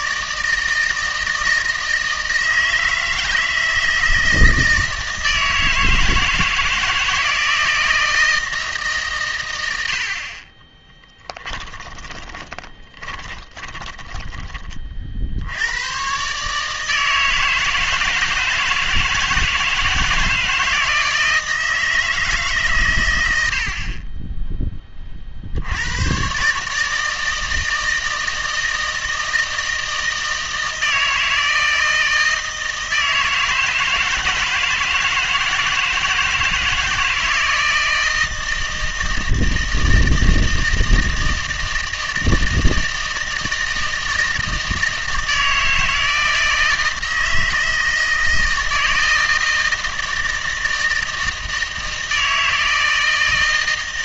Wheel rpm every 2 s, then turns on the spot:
160, 160, 160, 160, 150, 10, 20, 40, 160, 160, 160, 130, 20, 150, 160, 160, 160, 160, 160, 160, 160, 160, 160, 160, 160, 160, 160.
10-14